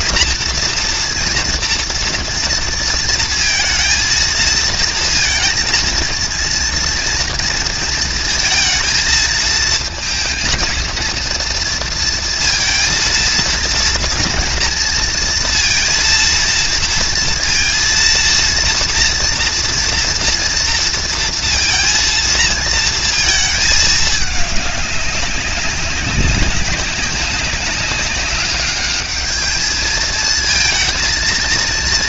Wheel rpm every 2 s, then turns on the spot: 230, 230, 230, 230, 230, 230, 230, 230, 230, 230, 230, 230, 200, 200, 210, 230.
none